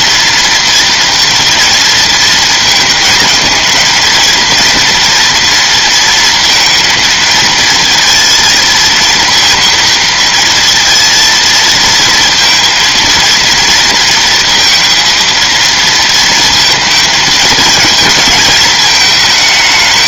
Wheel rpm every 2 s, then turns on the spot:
230, 220, 230, 230, 230, 230, 230, 230, 230, 220.
none